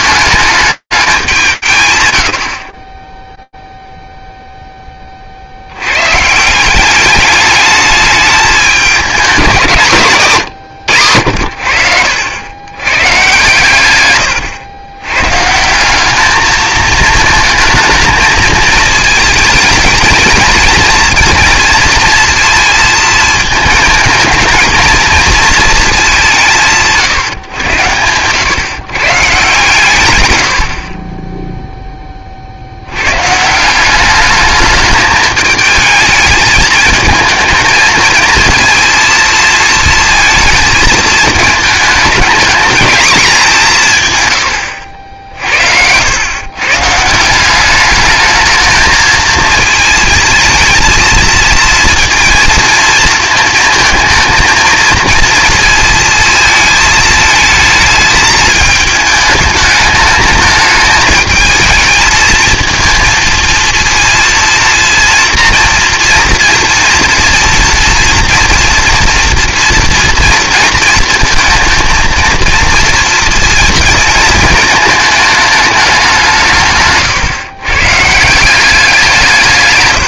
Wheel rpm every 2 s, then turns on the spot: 210, 80, 0, 170, 210, 140, 120, 100, 220, 220, 230, 230, 220, 150, 130, 50, 90, 210, 220, 230, 220, 210, 90, 160, 220, 220, 220, 230, 220, 210, 220, 230, 230, 230, 230, 220, 230, 220, 140, 180.
44-46